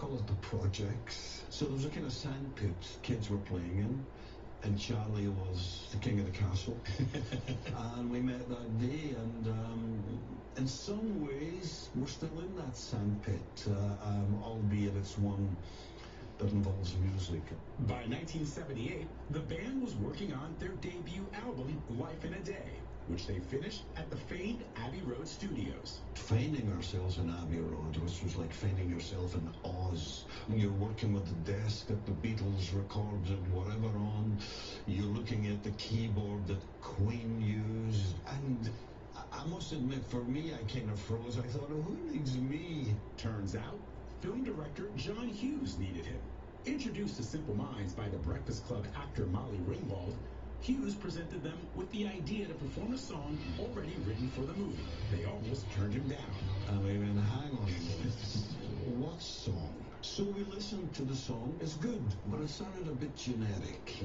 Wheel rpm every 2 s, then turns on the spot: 0, 0, 0, 0, 0, 0, 0, 0, 0, 0, 0, 0, 0, 0, 0, 0, 0, 0, 0, 0, 0, 0, 0, 0, 0, 0, 0, 0, 0, 0, 0, 0.
none